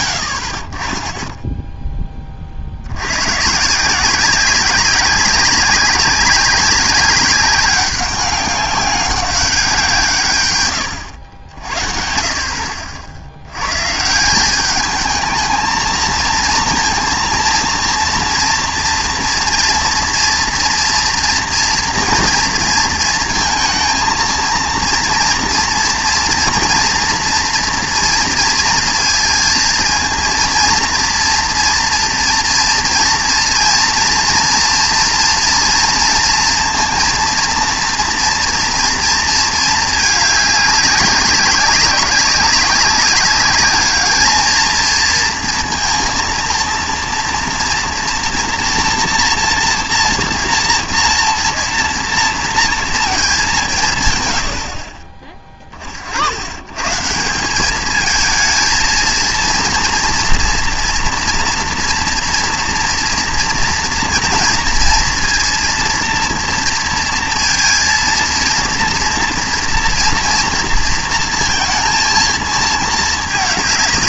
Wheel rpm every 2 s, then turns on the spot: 60, 90, 200, 190, 190, 100, 70, 220, 230, 230, 230, 230, 230, 230, 230, 230, 230, 230, 230, 230, 200, 190, 230, 230, 240, 230, 220, 20, 150, 230, 230, 230, 230, 230, 230, 230, 220.
none